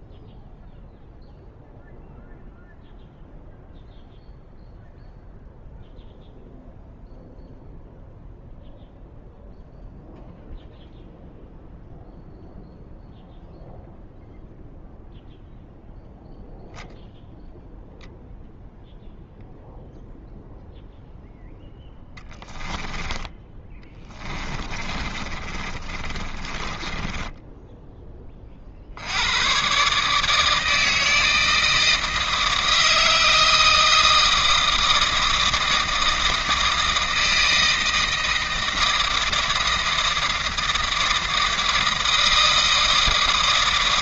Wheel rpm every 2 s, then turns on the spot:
0, 0, 0, 0, 0, 0, 0, 0, 0, 0, 0, 10, 30, 20, 40, 160, 160, 160, 160, 160, 160, 160.
22-28